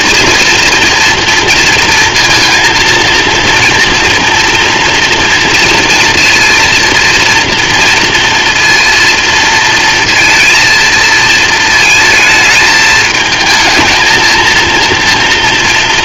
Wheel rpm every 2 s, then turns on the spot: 230, 230, 240, 230, 230, 230, 220, 230.
none